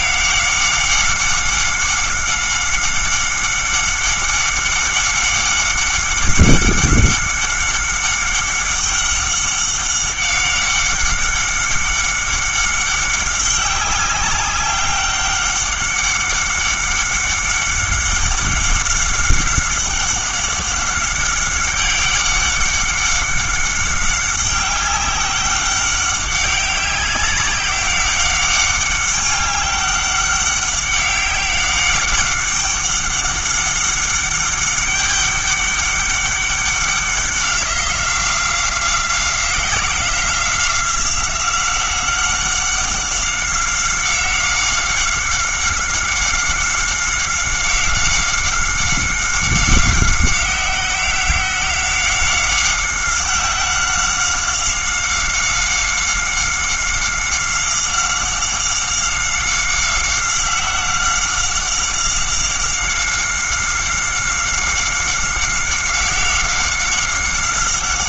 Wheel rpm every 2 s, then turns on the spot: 190, 190, 190, 190, 190, 190, 190, 190, 190, 190, 190, 200, 200, 190, 190, 200, 200, 200, 190, 180, 180, 190, 190, 190, 190, 190, 190, 190, 190, 190, 190, 190, 190, 190.
none